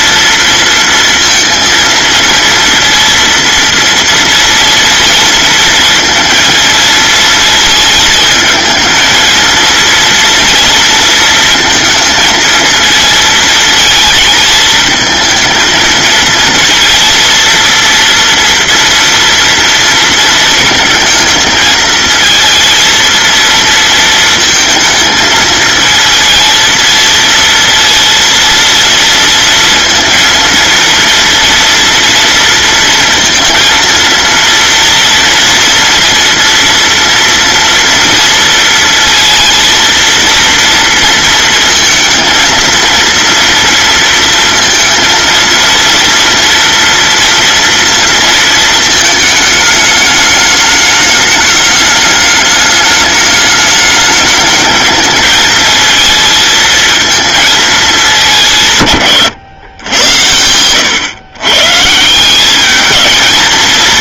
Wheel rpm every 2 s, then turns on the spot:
230, 230, 230, 230, 220, 230, 230, 220, 230, 230, 220, 220, 230, 220, 230, 230, 230, 230, 240, 230, 230, 230, 230, 240, 230, 210, 210, 210, 230, 170, 100, 200.
none